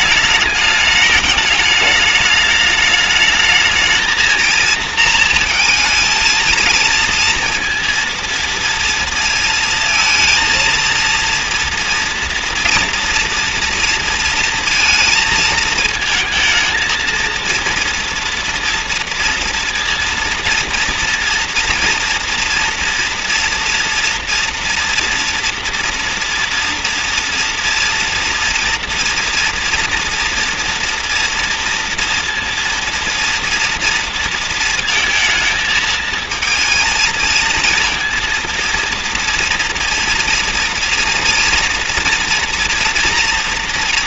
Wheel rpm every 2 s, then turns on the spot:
210, 210, 230, 220, 230, 230, 240, 230, 220, 240, 230, 230, 230, 230, 230, 230, 230, 230, 220, 230, 230, 230.
none